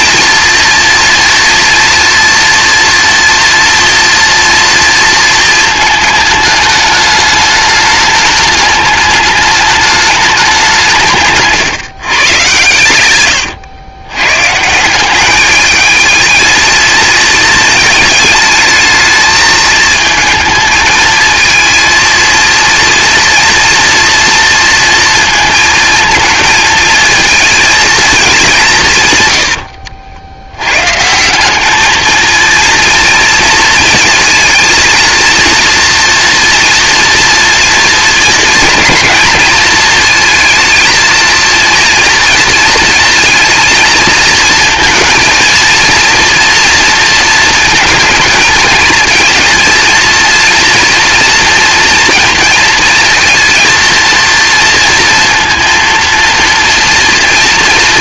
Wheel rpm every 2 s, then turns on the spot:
240, 230, 230, 220, 210, 170, 110, 180, 230, 220, 220, 230, 230, 220, 170, 120, 230, 230, 240, 230, 230, 230, 220, 230, 220, 230, 230, 230, 230.
none